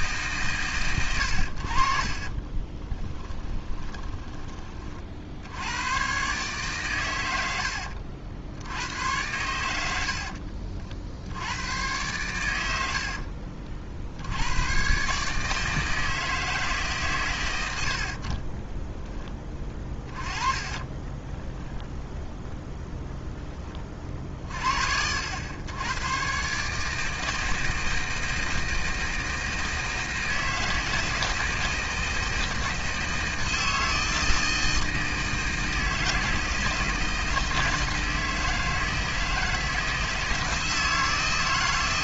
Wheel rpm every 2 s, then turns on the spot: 120, 20, 30, 130, 90, 50, 70, 120, 150, 10, 20, 0, 60, 150, 160, 160, 160, 160, 160, 160, 160.
2-4 18-20